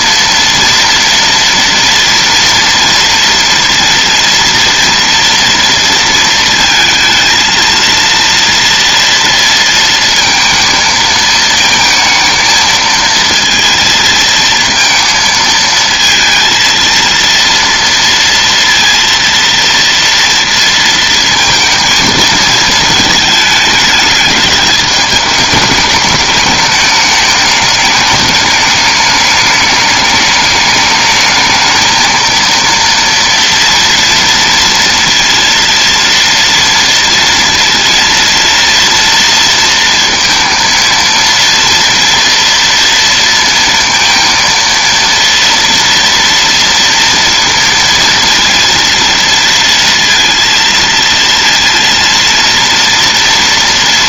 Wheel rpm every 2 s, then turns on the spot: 230, 230, 230, 230, 230, 230, 220, 230, 230, 230, 230, 220, 210, 210, 210, 210, 230, 230, 230, 230, 230, 230, 230, 230, 230, 230, 230.
none